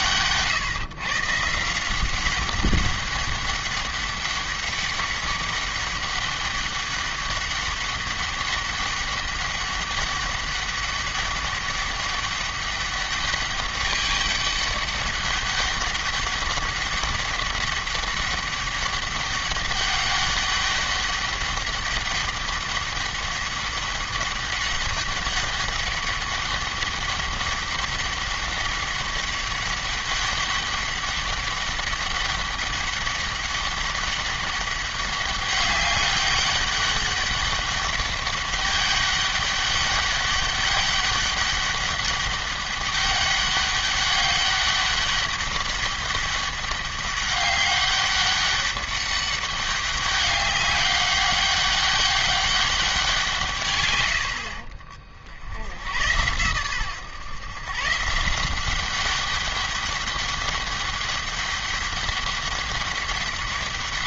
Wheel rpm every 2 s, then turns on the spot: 130, 190, 200, 200, 200, 200, 200, 200, 200, 200, 200, 190, 200, 200, 200, 200, 200, 200, 200, 200, 200, 200, 200, 200, 200, 200, 190, 50, 120, 190, 200, 200.
none